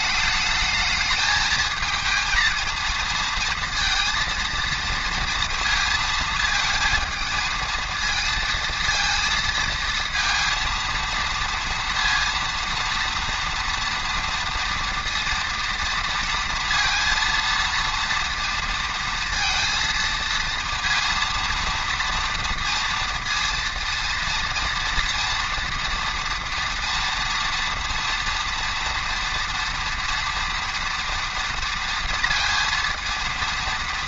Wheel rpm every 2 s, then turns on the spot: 220, 230, 230, 220, 230, 230, 230, 230, 230, 230, 230, 230, 230, 230, 230, 230, 230.
none